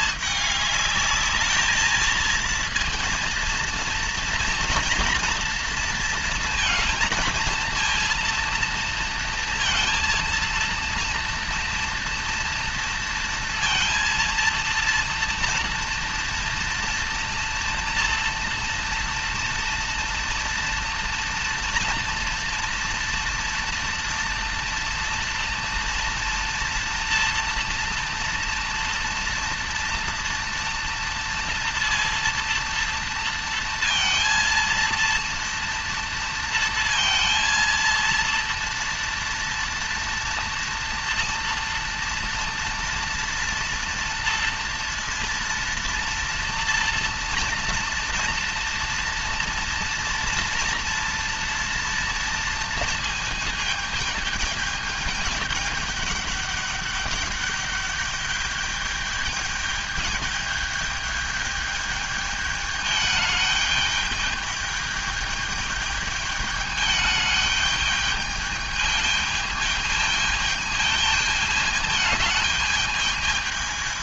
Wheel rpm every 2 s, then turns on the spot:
210, 230, 230, 230, 230, 230, 230, 230, 230, 230, 230, 230, 230, 230, 230, 230, 230, 230, 230, 230, 230, 240, 230, 230, 240, 240, 230, 220, 210, 210, 210, 210, 210, 210, 210, 220, 210.
none